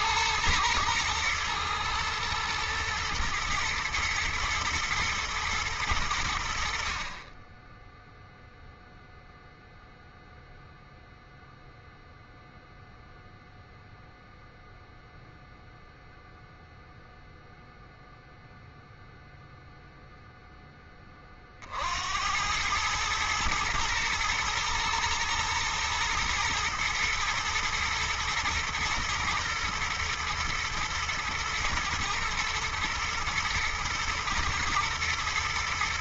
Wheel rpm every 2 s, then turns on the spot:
110, 110, 120, 50, 0, 0, 0, 0, 0, 0, 20, 110, 110, 120, 110, 110, 120, 110.
none